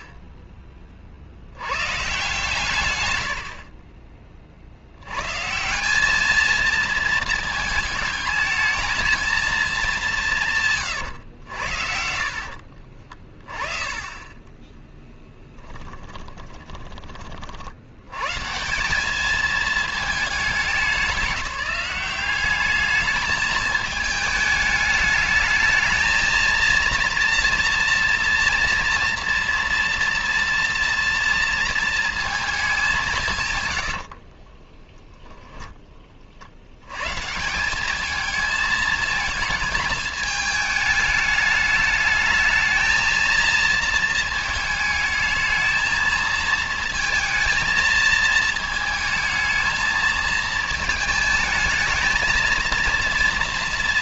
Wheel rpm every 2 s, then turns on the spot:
120, 30, 200, 220, 200, 70, 20, 10, 100, 210, 190, 220, 220, 240, 230, 230, 80, 20, 200, 220, 210, 230, 220, 220, 220, 220, 230.
10-16 32-34